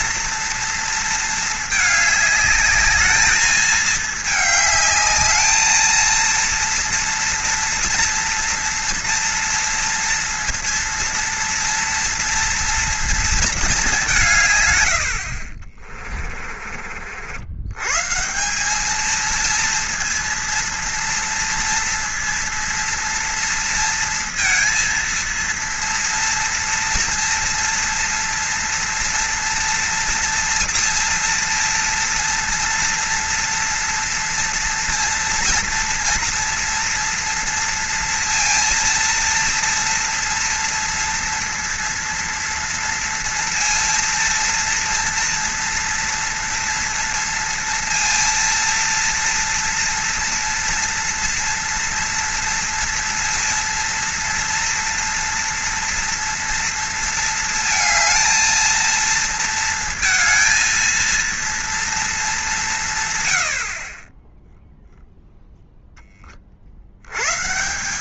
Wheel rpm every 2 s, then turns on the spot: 230, 210, 210, 230, 230, 230, 230, 120, 40, 200, 230, 230, 230, 230, 240, 230, 230, 230, 230, 230, 230, 230, 230, 230, 230, 230, 230, 230, 230, 230, 230, 170, 0, 60.
none